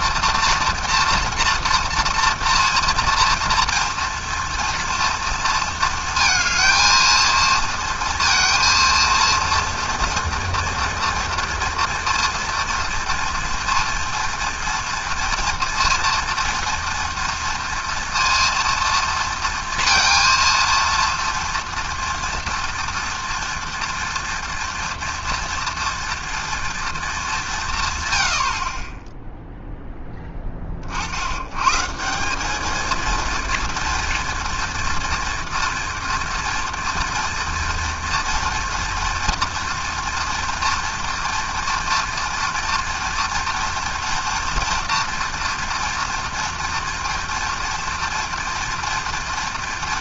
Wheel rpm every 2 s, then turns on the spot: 230, 230, 230, 230, 230, 230, 230, 230, 240, 230, 230, 230, 230, 230, 60, 30, 210, 230, 230, 240, 230, 230, 230, 230, 230.
none